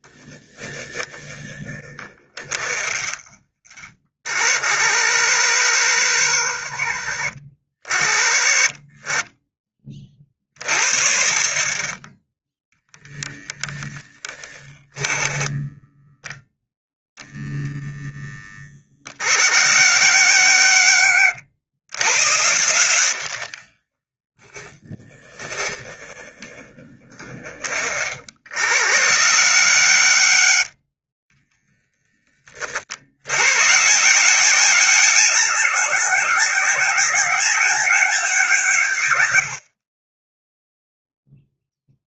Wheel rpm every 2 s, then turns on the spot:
10, 20, 50, 50, 20, 40, 0, 10, 0, 40, 80, 80, 10, 20, 70, 30, 60, 190, 200, 130, 0.
2-4 14-16 22-28